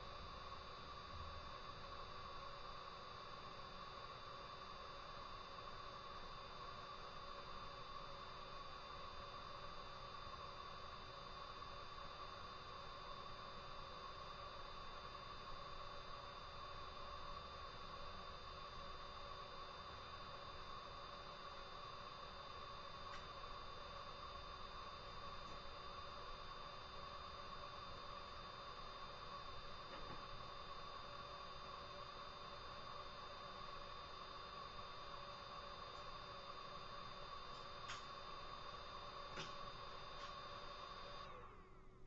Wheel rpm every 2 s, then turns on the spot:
0, 0, 0, 0, 0, 0, 0, 0, 0, 0, 0, 0, 0, 0, 0, 0, 0, 0, 0, 0, 0.
none